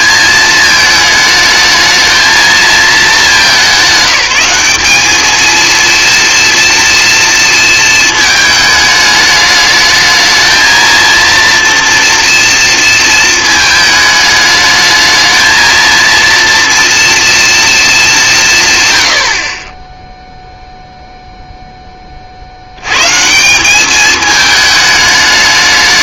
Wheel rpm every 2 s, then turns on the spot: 220, 220, 200, 230, 220, 220, 230, 210, 230, 140, 0, 80, 210.
none